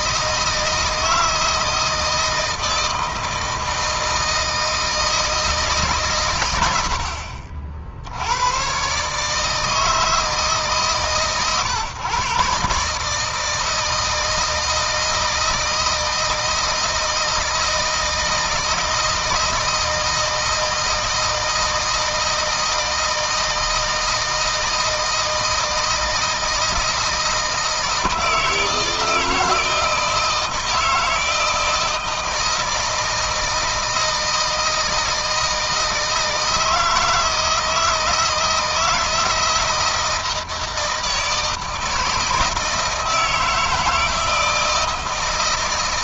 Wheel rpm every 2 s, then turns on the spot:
160, 160, 160, 80, 120, 150, 140, 160, 160, 160, 160, 160, 160, 160, 160, 160, 160, 160, 160, 160, 160, 160, 160.
none